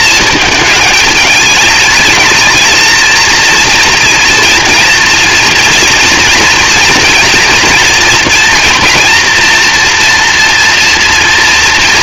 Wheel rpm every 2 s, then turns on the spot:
220, 220, 230, 230, 230, 230.
none